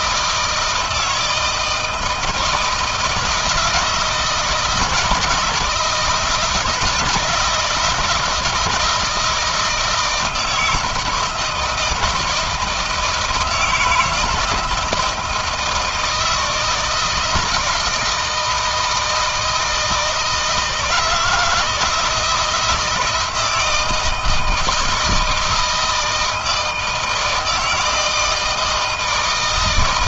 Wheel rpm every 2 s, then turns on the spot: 160, 160, 170, 160, 160, 160, 160, 160, 160, 160, 160, 160, 160, 160, 160.
none